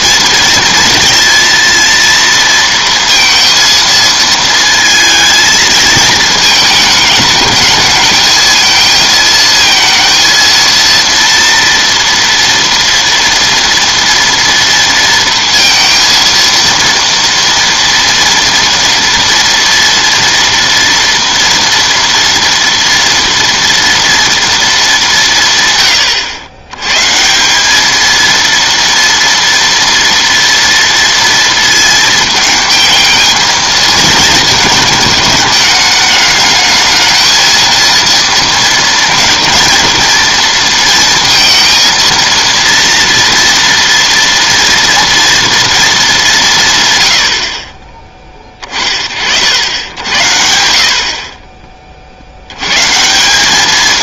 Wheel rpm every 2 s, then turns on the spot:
230, 230, 220, 220, 220, 230, 230, 230, 230, 230, 230, 230, 220, 100, 230, 230, 220, 220, 220, 230, 230, 230, 230, 150, 30, 70, 100.
none